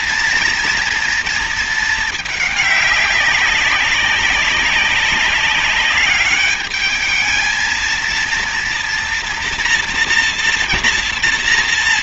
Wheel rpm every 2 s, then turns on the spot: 240, 200, 200, 210, 230, 230.
none